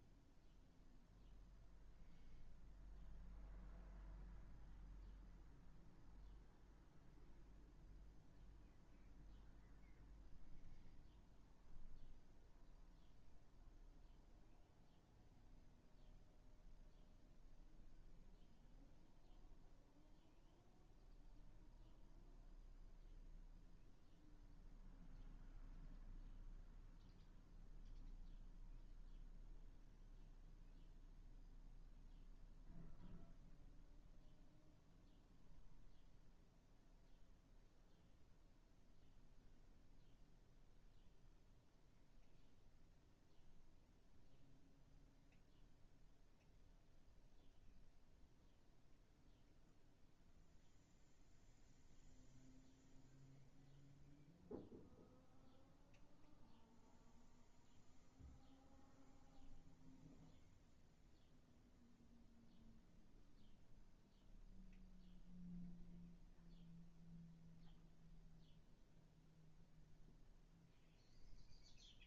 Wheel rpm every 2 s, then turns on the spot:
0, 0, 0, 0, 0, 0, 0, 0, 0, 0, 0, 0, 0, 0, 0, 0, 0, 0, 0, 0, 0, 0, 0, 0, 0, 0, 0, 0, 0, 0, 0, 0, 0, 0, 0, 0.
none